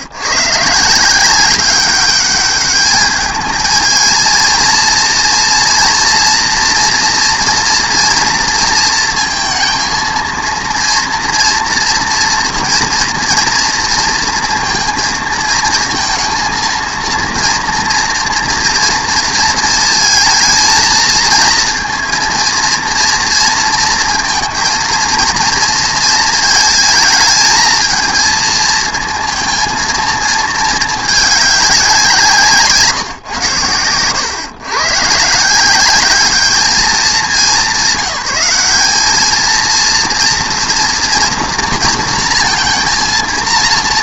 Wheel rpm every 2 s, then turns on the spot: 140, 210, 220, 230, 230, 230, 230, 230, 230, 230, 230, 230, 230, 220, 230, 220, 150, 120, 210, 190, 230, 230.
none